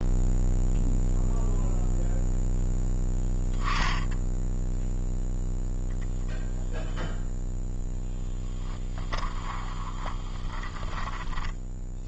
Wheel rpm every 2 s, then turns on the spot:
0, 0, 0, 0, 10, 20.
10-12